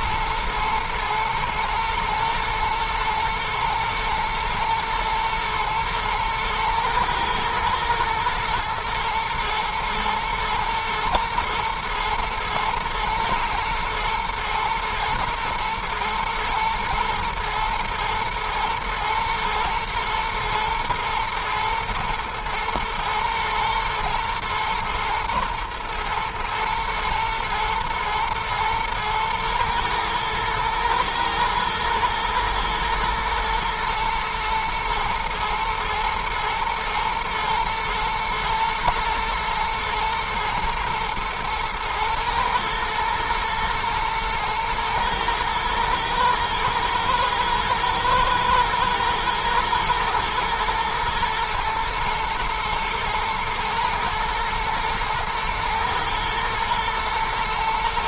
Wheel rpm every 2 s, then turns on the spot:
110, 120, 110, 110, 120, 110, 110, 110, 120, 110, 110, 110, 110, 110, 110, 120, 120, 110, 110, 110, 120, 120, 110, 110, 110, 120, 110, 110, 110.
none